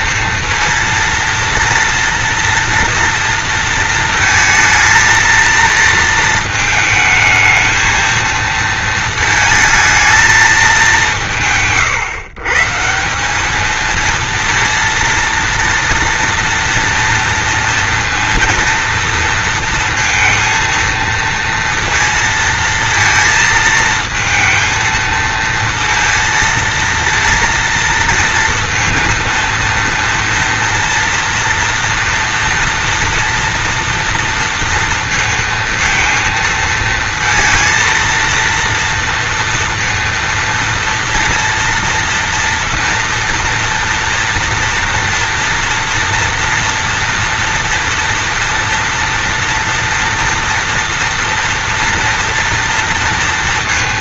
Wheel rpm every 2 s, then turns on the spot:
230, 230, 230, 220, 230, 210, 150, 230, 230, 230, 230, 230, 220, 230, 230, 230, 230, 230, 230, 230, 230, 230, 230, 230, 230, 230, 230.
none